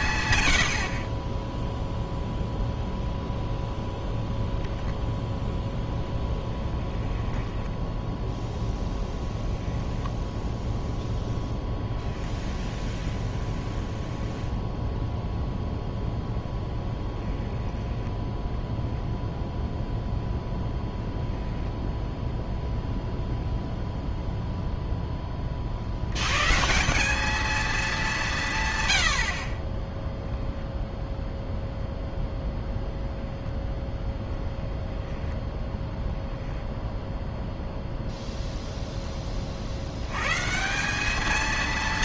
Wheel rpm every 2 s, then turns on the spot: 80, 0, 0, 10, 10, 0, 0, 0, 0, 0, 0, 0, 0, 140, 150, 0, 0, 0, 0, 0, 160.
8-10